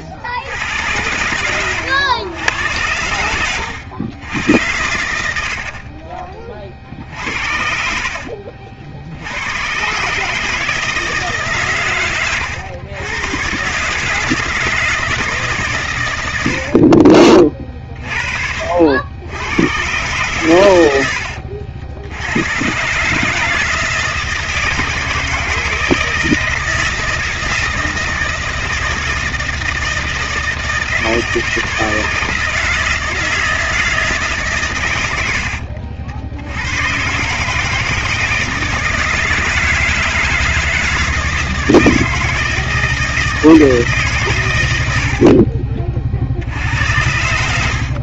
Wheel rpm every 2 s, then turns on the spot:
100, 100, 50, 70, 120, 130, 130, 130, 40, 100, 70, 160, 160, 160, 160, 160, 160, 70, 140, 160, 160, 160, 40, 80.
0-2 4-8 44-46